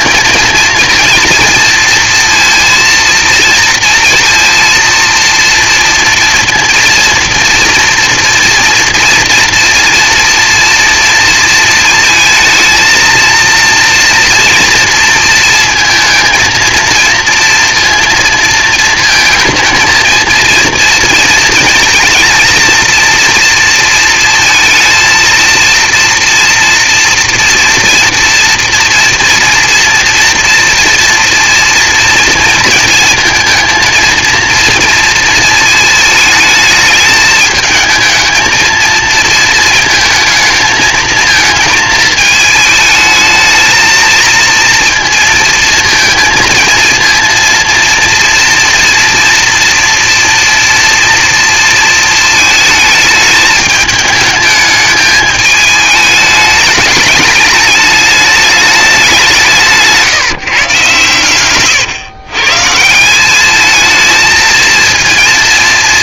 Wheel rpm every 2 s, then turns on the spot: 230, 230, 230, 230, 230, 230, 220, 230, 230, 230, 230, 230, 230, 230, 230, 230, 230, 230, 220, 230, 220, 210, 230, 230, 230, 240, 220, 210, 210, 210, 150, 150, 230.
none